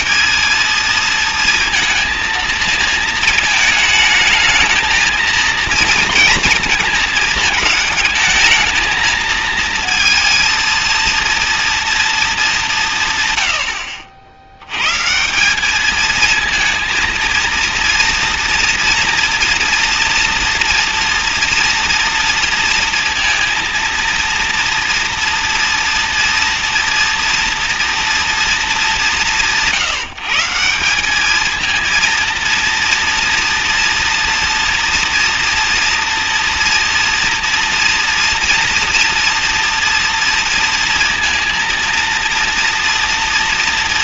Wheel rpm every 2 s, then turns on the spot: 220, 230, 220, 230, 220, 220, 200, 90, 230, 230, 240, 230, 230, 230, 220, 170, 230, 230, 230, 230, 230, 230.
none